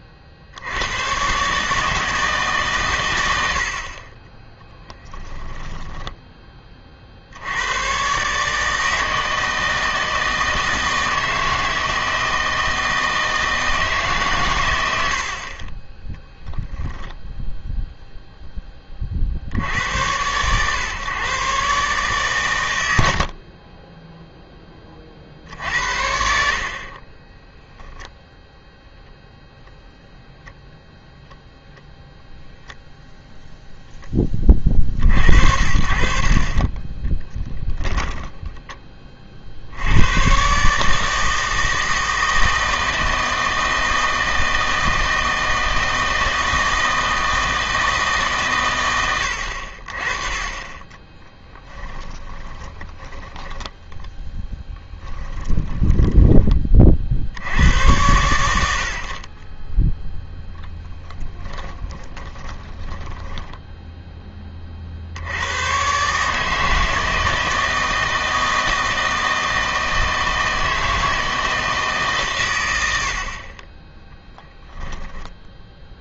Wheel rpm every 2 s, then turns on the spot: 90, 140, 10, 30, 150, 160, 160, 100, 0, 20, 120, 100, 10, 50, 0, 0, 0, 40, 20, 20, 150, 160, 160, 160, 110, 30, 20, 10, 30, 70, 0, 10, 30, 160, 160, 160, 110, 10.
4-6 50-54 62-64